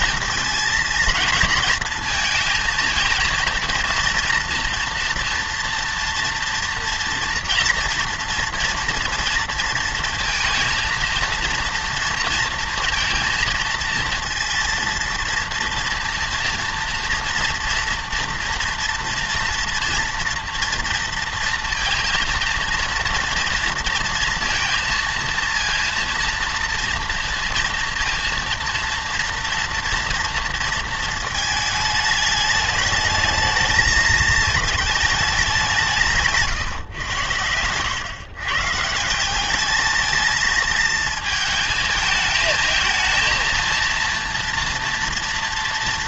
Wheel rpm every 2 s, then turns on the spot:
230, 220, 230, 240, 240, 230, 230, 230, 240, 230, 240, 230, 230, 230, 230, 230, 210, 220, 140, 140, 220, 220, 230.
36-38